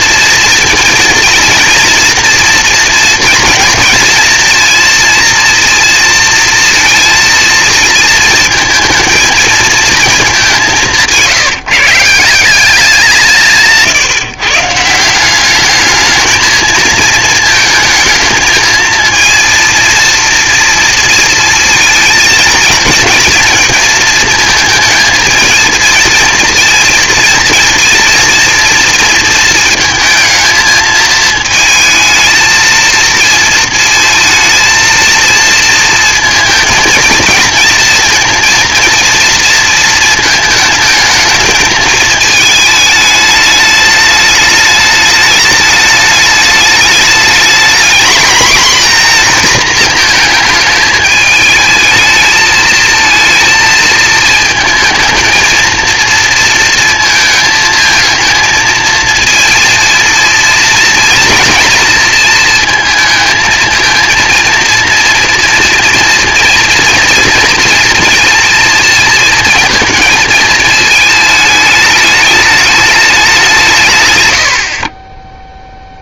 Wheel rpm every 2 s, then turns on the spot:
230, 230, 230, 230, 230, 170, 180, 160, 220, 230, 230, 220, 230, 230, 230, 220, 220, 230, 220, 230, 220, 210, 210, 210, 240, 210, 220, 220, 230, 220, 230, 220, 230, 230, 230, 220, 210, 40.
74-76